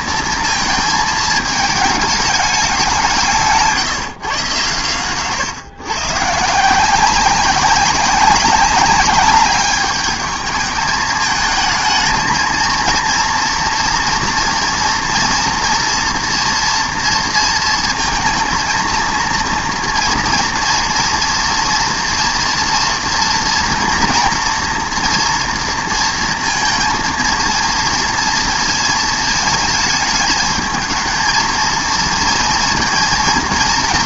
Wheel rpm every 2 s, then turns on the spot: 220, 200, 120, 160, 200, 210, 230, 240, 230, 230, 230, 230, 230, 230, 230, 220, 230.
none